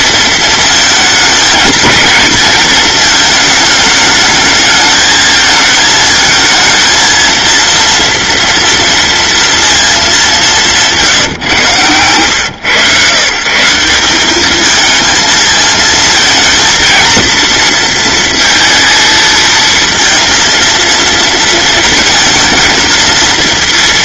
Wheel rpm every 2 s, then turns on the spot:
220, 230, 220, 230, 230, 180, 120, 220, 230, 230, 230, 230.
none